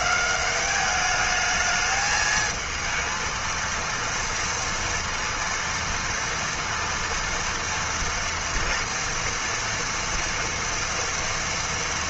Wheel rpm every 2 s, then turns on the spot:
200, 220, 230, 230, 230, 230.
none